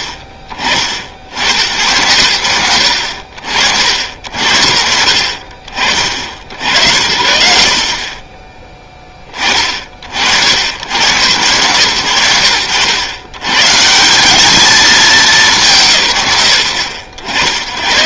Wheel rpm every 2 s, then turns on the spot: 40, 60, 90, 70, 30, 90, 90, 220, 130.
none